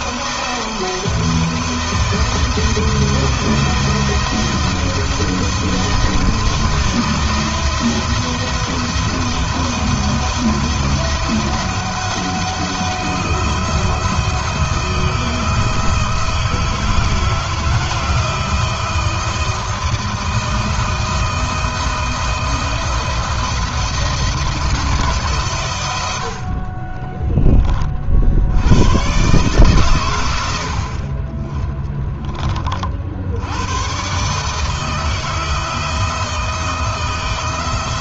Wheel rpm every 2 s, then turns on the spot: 170, 170, 170, 170, 170, 170, 170, 170, 160, 170, 160, 170, 160, 30, 120, 40, 60, 160, 160.
26-28